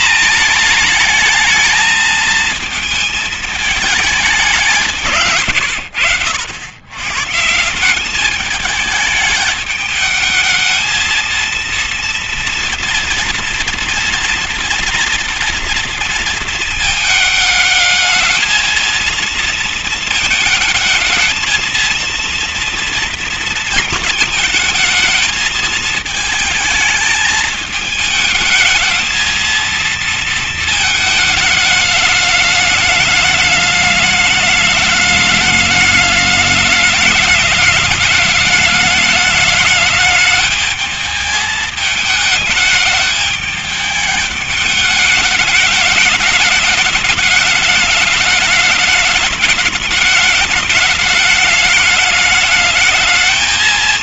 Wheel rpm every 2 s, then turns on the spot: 230, 220, 190, 90, 200, 220, 230, 230, 220, 220, 220, 230, 220, 220, 220, 220, 210, 210, 210, 210, 210, 220, 210, 210, 210, 210, 210.
none